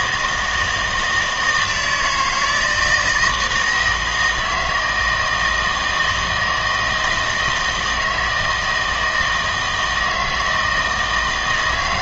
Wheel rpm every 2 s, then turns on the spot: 160, 160, 160, 160, 160, 160.
none